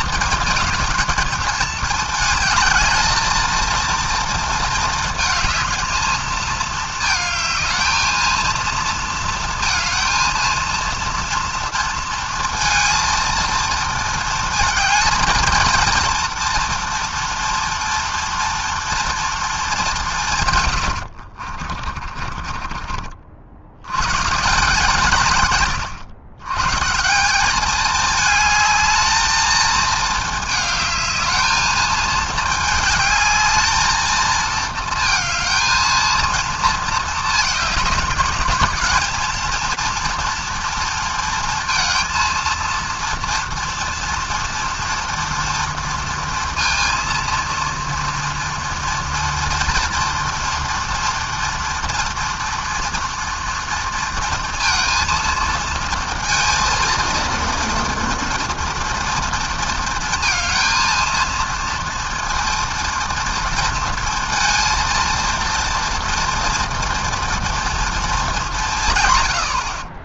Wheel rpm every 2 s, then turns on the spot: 220, 220, 220, 220, 230, 230, 230, 220, 230, 230, 150, 40, 140, 120, 210, 220, 220, 230, 220, 210, 230, 230, 230, 230, 230, 230, 240, 230, 230, 230, 230, 230, 230, 230, 180.
22-24